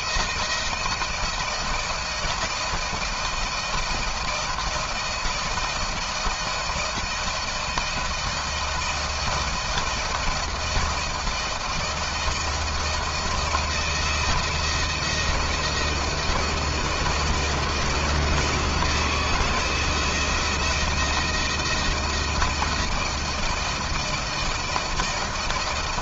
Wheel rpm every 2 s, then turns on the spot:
160, 160, 160, 160, 160, 170, 170, 160, 160, 170, 160, 160, 160.
none